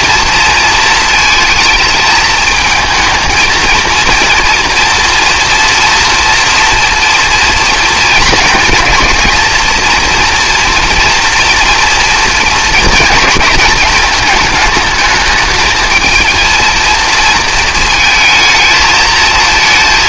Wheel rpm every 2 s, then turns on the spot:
230, 220, 230, 240, 220, 230, 220, 210, 230, 220.
none